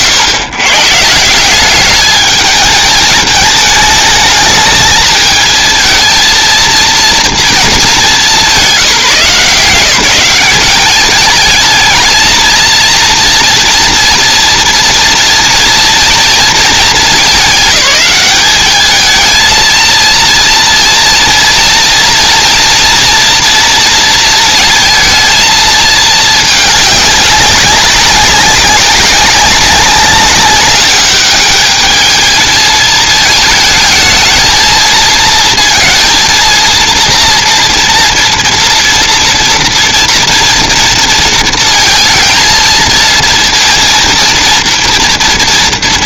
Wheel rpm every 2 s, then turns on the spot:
140, 210, 220, 230, 170, 200, 230, 230, 220, 210, 230, 230, 230, 210, 190, 200, 220, 220, 230, 230, 230, 230, 230.
none